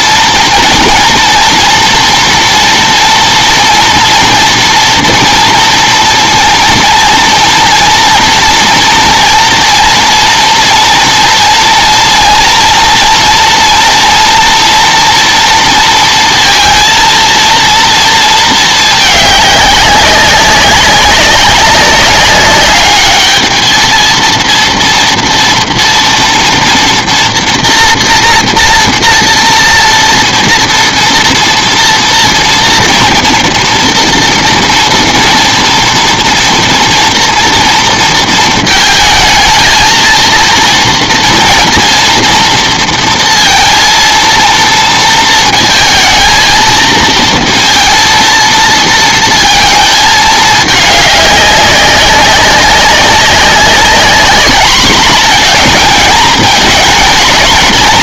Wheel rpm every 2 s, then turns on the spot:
230, 230, 230, 230, 230, 240, 230, 230, 230, 210, 190, 210, 230, 230, 240, 230, 230, 230, 230, 220, 230, 230, 230, 230, 230, 210, 190, 210, 220.
none